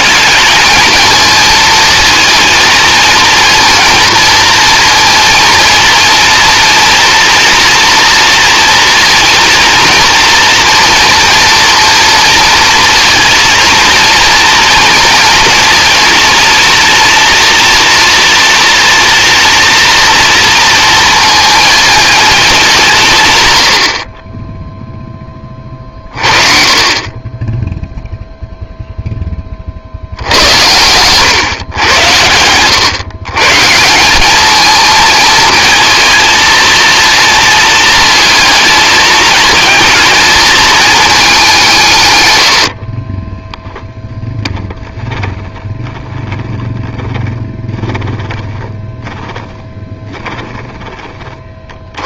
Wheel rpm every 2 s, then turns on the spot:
220, 220, 230, 230, 230, 230, 230, 230, 230, 240, 230, 220, 20, 30, 0, 90, 110, 220, 230, 220, 220, 90, 10, 10, 10, 10.
42-44